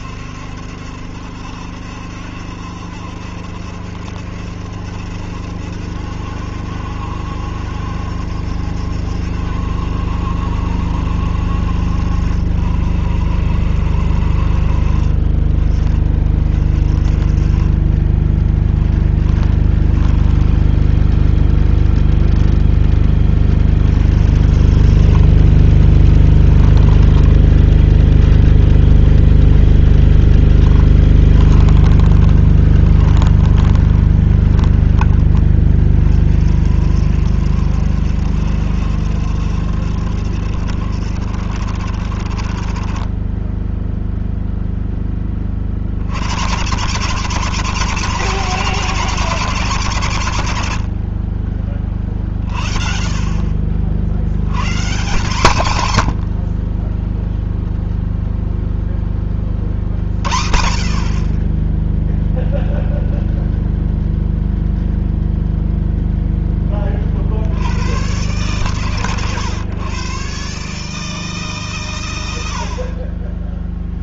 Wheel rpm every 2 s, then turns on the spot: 70, 70, 70, 70, 70, 70, 60, 50, 40, 20, 0, 10, 40, 10, 0, 20, 20, 20, 60, 70, 50, 20, 10, 190, 200, 50, 40, 140, 10, 20, 50, 0, 0, 40, 130, 150, 30.
18-20 24-28 30-34